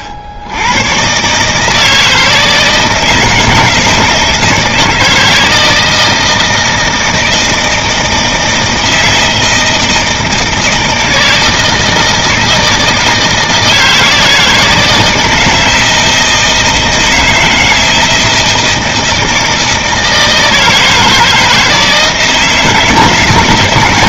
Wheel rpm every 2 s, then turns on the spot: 80, 160, 160, 160, 160, 160, 160, 160, 160, 160, 160, 160.
none